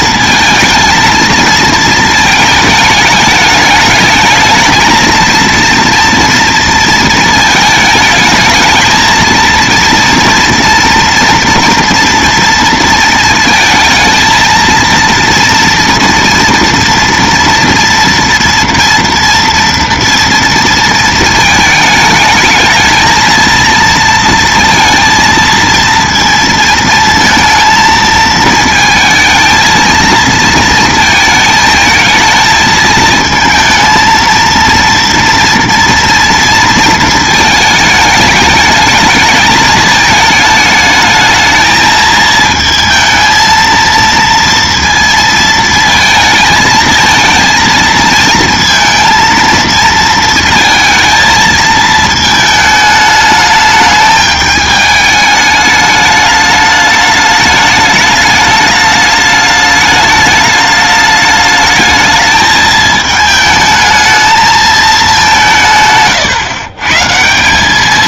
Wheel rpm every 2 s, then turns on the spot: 230, 210, 220, 230, 220, 230, 230, 230, 230, 230, 230, 220, 230, 230, 220, 220, 220, 230, 230, 210, 220, 220, 230, 220, 230, 220, 220, 210, 210, 210, 210, 220, 210, 140.
none